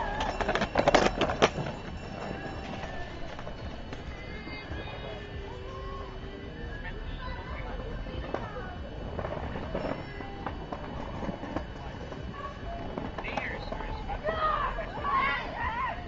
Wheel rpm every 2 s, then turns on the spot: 0, 0, 0, 0, 0, 0, 0, 0.
none